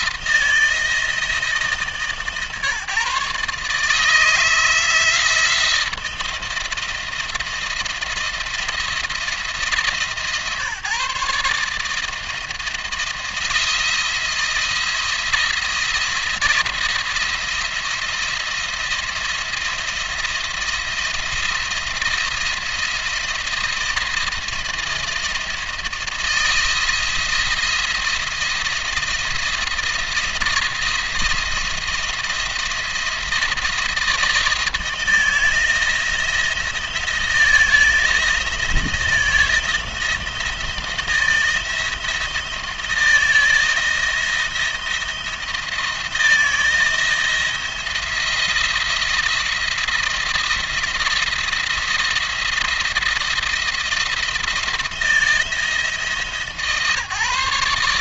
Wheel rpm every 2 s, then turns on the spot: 160, 150, 160, 170, 170, 150, 170, 170, 170, 170, 170, 160, 160, 160, 170, 170, 160, 160, 160, 160, 170, 170, 170, 160, 170, 170, 170, 160, 150.
none